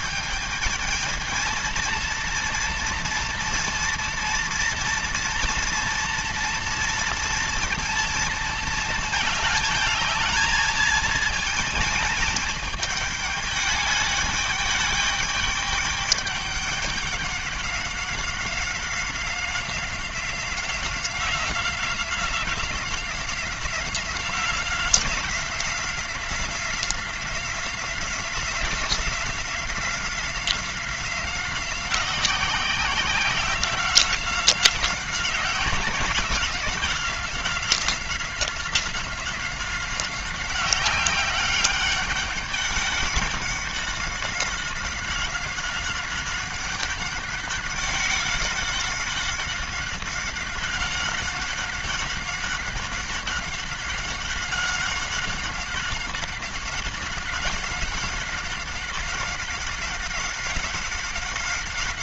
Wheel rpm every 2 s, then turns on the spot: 220, 230, 230, 240, 230, 220, 220, 210, 200, 190, 180, 180, 180, 180, 180, 180, 180, 180, 180, 190, 190, 200, 190, 190, 190, 190, 190, 190, 190, 190, 190.
none